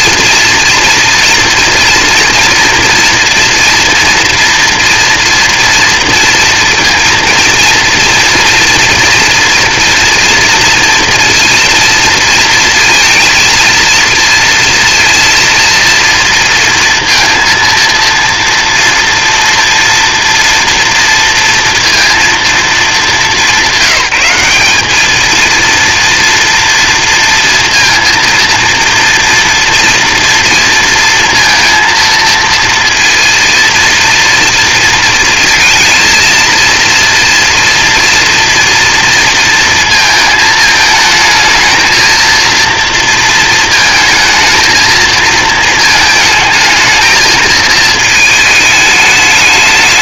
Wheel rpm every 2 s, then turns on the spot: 230, 230, 240, 230, 230, 230, 230, 230, 230, 230, 230, 230, 190, 230, 230, 230, 230, 230, 230, 240, 220, 230, 220, 220, 220.
none